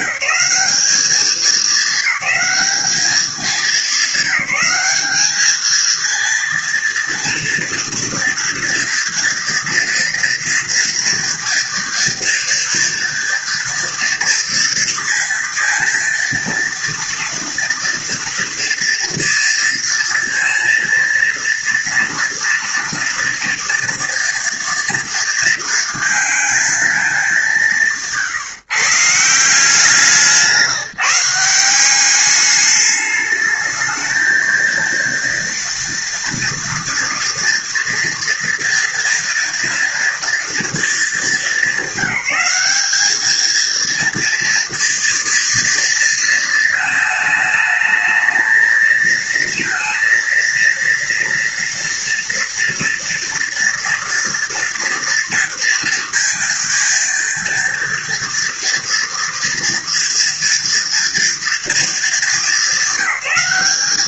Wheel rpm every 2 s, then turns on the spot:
200, 210, 210, 230, 240, 230, 230, 230, 230, 230, 230, 230, 230, 210, 160, 170, 210, 230, 230, 240, 220, 210, 240, 220, 230, 230, 230, 230, 230, 230, 230, 200.
none